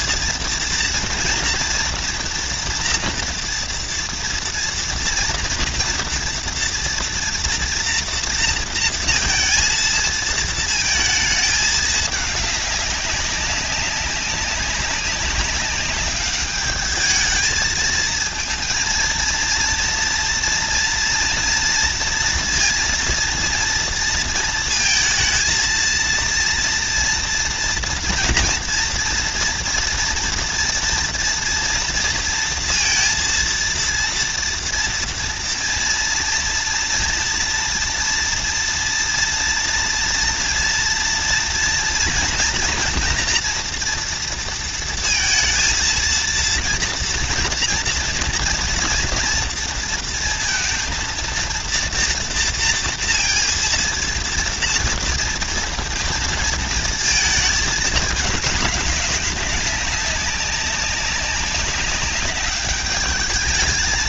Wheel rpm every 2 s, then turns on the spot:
230, 240, 230, 230, 230, 230, 200, 190, 210, 230, 240, 230, 230, 230, 240, 240, 230, 230, 230, 230, 240, 230, 230, 230, 230, 230, 230, 230, 230, 210, 190, 200.
none